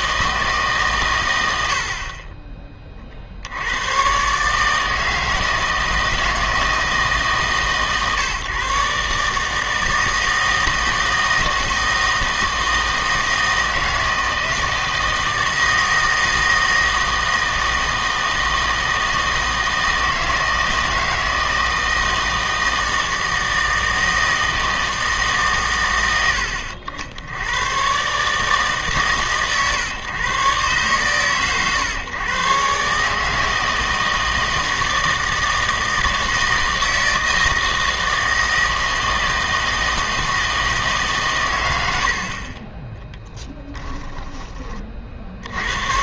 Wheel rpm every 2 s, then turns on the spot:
150, 20, 150, 160, 140, 160, 160, 160, 160, 160, 160, 160, 160, 70, 150, 130, 130, 160, 160, 160, 150, 20, 30.
42-44